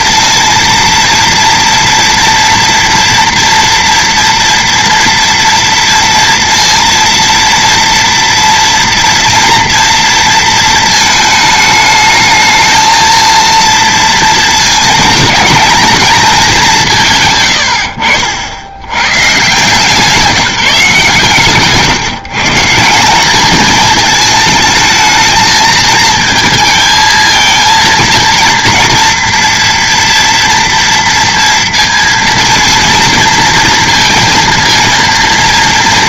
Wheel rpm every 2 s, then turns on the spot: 230, 230, 230, 230, 230, 220, 220, 220, 200, 80, 180, 150, 220, 220, 230, 230, 230, 230.
none